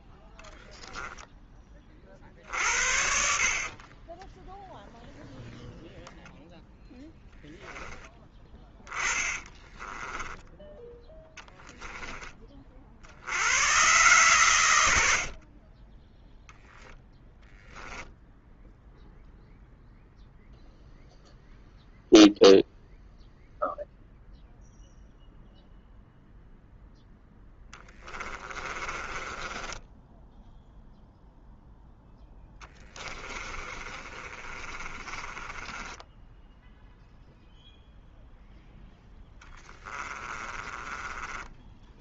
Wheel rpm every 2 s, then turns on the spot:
10, 60, 0, 0, 20, 20, 60, 90, 0, 0, 0, 0, 0, 0, 30, 0, 10, 30, 0, 0, 20.
8-10 14-16 28-30 32-36 40-42